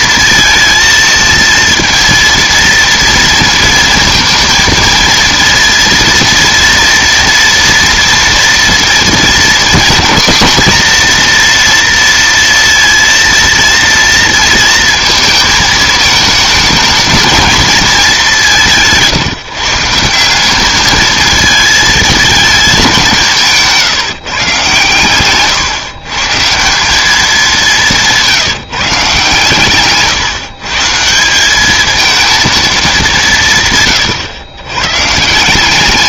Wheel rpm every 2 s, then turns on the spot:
230, 230, 230, 230, 230, 230, 230, 230, 210, 180, 200, 210, 140, 160, 160, 140, 230, 100.
none